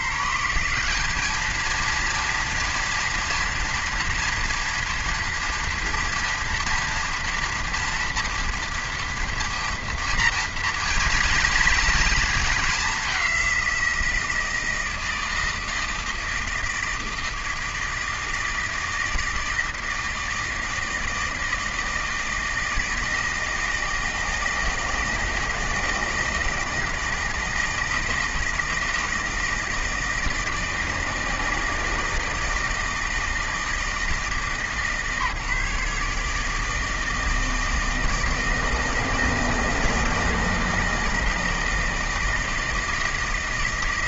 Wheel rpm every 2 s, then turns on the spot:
170, 230, 230, 230, 230, 230, 210, 170, 160, 160, 160, 160, 160, 160, 160, 160, 160, 150, 160, 160, 160, 160.
none